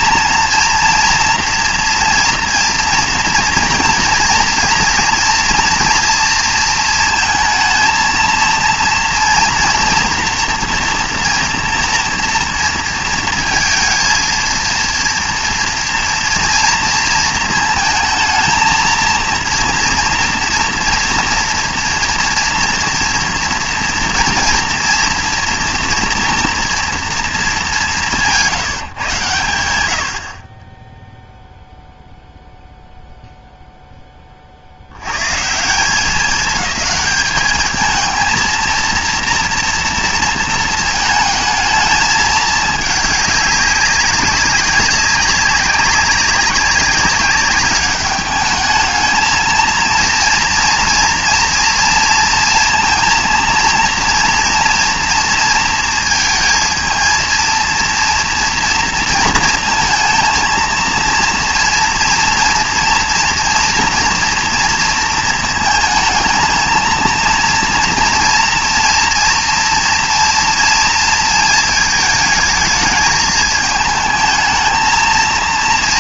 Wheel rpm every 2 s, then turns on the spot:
230, 230, 230, 230, 230, 230, 230, 230, 230, 230, 230, 230, 230, 240, 170, 30, 0, 40, 210, 230, 220, 210, 200, 200, 210, 230, 230, 230, 220, 230, 230, 230, 230, 220, 230, 230, 220, 220.
none